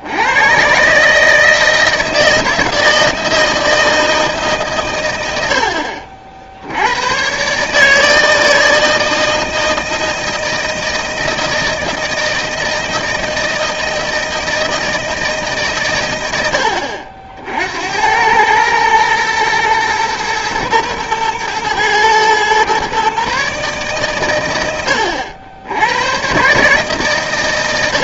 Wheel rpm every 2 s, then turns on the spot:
120, 160, 130, 70, 160, 160, 160, 160, 90, 110, 110, 120, 100, 140.
none